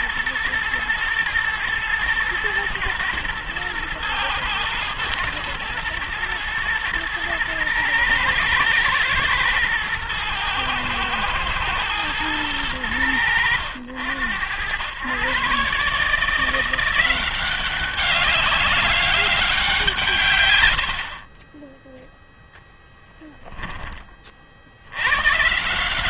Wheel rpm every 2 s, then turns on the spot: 120, 110, 120, 110, 110, 110, 100, 100, 180, 200, 60, 0, 100.
none